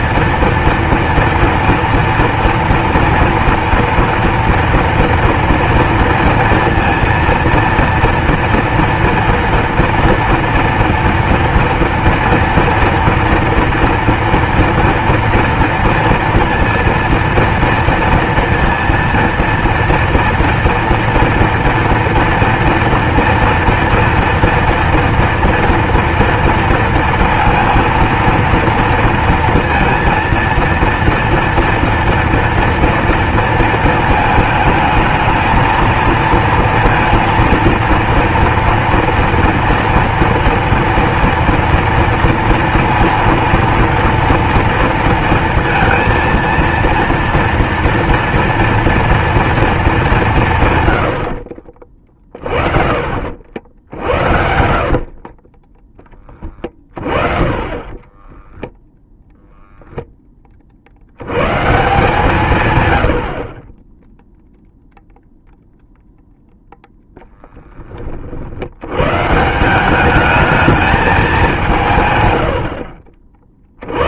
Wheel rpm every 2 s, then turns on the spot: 230, 230, 230, 230, 240, 230, 230, 230, 230, 230, 230, 230, 230, 230, 230, 230, 230, 220, 230, 230, 230, 230, 230, 230, 230, 130, 40, 50, 30, 0, 70, 120, 0, 0, 110, 210, 70.
54-56